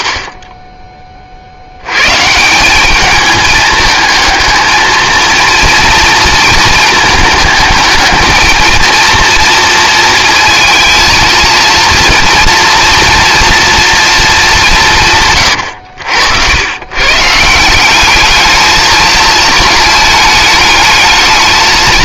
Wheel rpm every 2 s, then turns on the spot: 80, 140, 220, 230, 220, 230, 230, 230, 100, 200, 220.
none